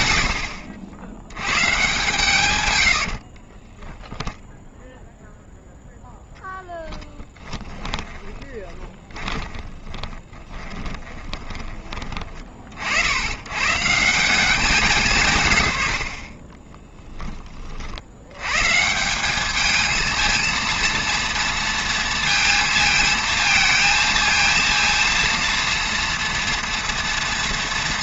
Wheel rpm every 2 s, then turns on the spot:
20, 0, 10, 20, 20, 100, 140, 10, 180, 230, 220, 230, 230, 220.
0-2 4-10